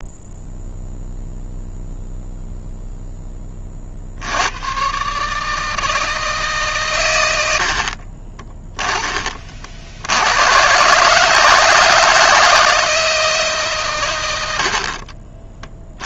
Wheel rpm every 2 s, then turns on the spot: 0, 0, 110, 150, 30, 110, 160, 70.
8-10 14-16